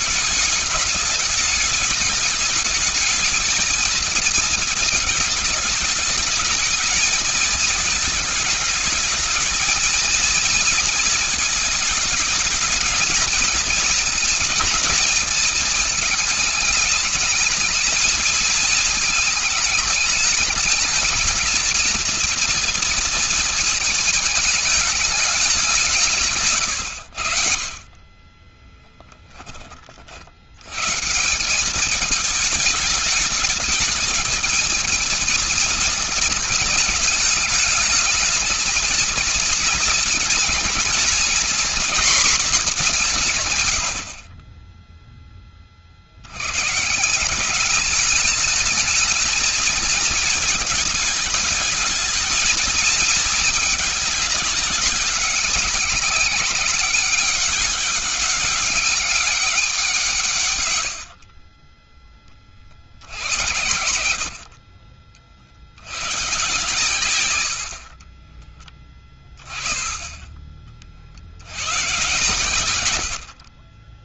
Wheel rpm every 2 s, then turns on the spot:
210, 220, 220, 220, 220, 230, 220, 230, 220, 220, 220, 230, 210, 100, 10, 140, 210, 220, 210, 220, 230, 190, 10, 140, 210, 220, 220, 200, 200, 200, 100, 60, 40, 120, 20, 50, 100.
28-30 44-46